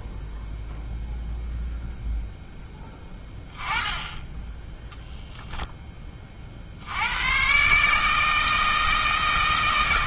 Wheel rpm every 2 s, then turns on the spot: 0, 10, 10, 60, 160.
none